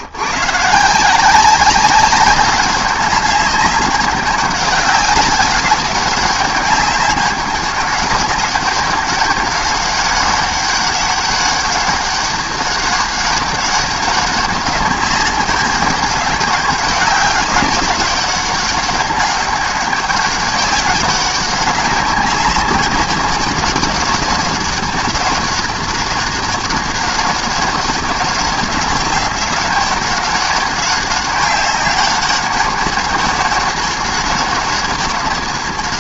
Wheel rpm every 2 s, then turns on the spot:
150, 200, 200, 200, 200, 200, 200, 200, 190, 200, 200, 200, 200, 200, 200, 200, 200, 200.
none